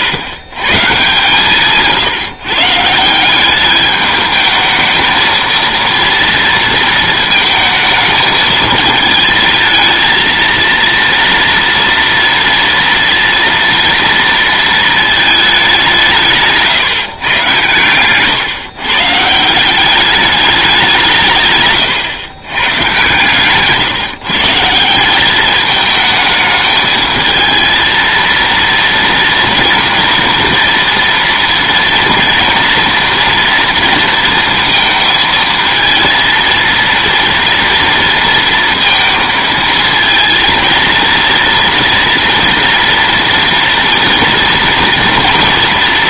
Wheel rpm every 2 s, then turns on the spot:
140, 160, 220, 230, 220, 230, 230, 230, 150, 140, 190, 120, 170, 220, 230, 230, 230, 230, 230, 230, 230, 230, 230.
none